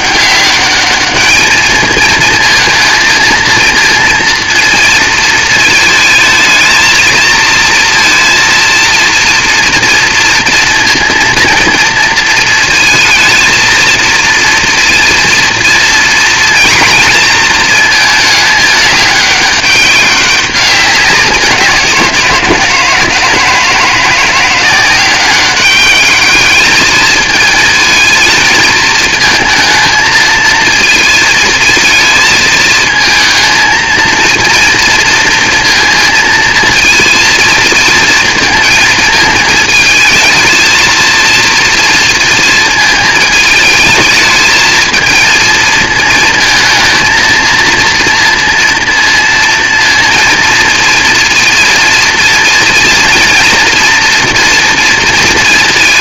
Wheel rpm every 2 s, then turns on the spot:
200, 230, 230, 220, 230, 230, 220, 230, 230, 220, 200, 160, 180, 210, 220, 220, 220, 230, 230, 220, 220, 230, 220, 230, 230, 230, 230, 230.
none